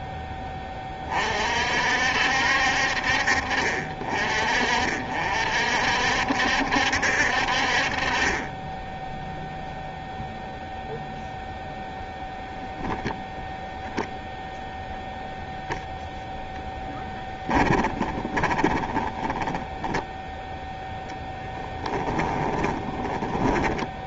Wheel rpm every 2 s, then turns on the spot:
20, 50, 50, 60, 10, 0, 0, 0, 10, 20, 0, 10.
18-20 22-24